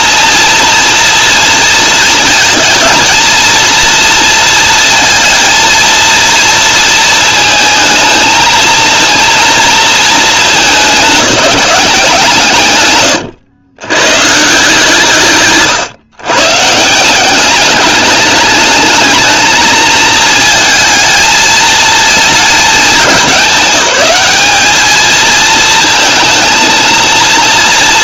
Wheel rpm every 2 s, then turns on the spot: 230, 230, 230, 230, 230, 200, 120, 150, 150, 220, 220, 220, 210, 230.
none